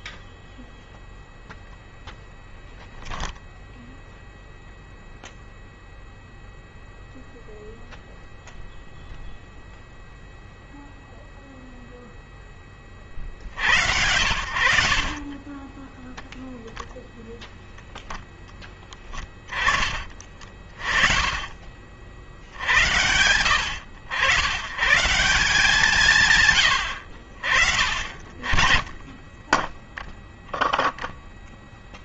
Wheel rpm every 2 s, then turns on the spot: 0, 0, 0, 0, 0, 0, 20, 60, 0, 10, 30, 90, 110, 170, 30, 0.
18-20